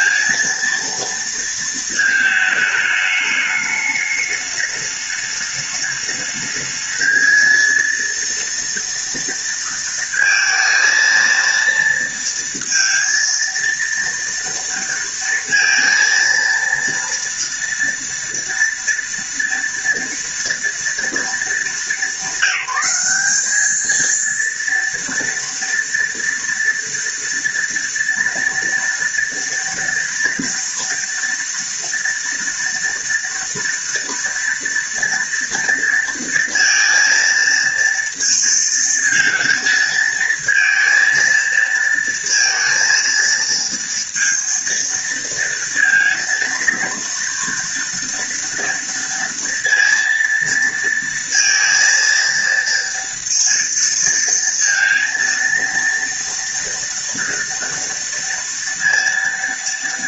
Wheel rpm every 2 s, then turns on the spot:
230, 210, 210, 220, 230, 230, 230, 230, 230, 230, 230, 190, 230, 230, 230, 230, 230, 230, 230, 230, 230, 230, 230, 230, 230, 230, 230, 230, 230, 230.
none